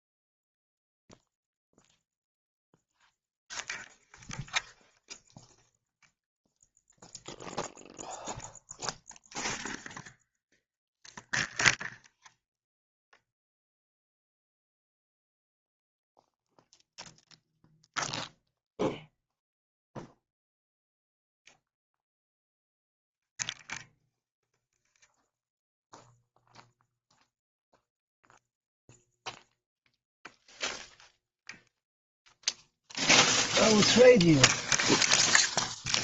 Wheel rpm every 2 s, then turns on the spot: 0, 0, 0, 0, 0, 0, 0, 0, 0, 0, 0, 0, 0, 0, 0, 0, 0, 0.
none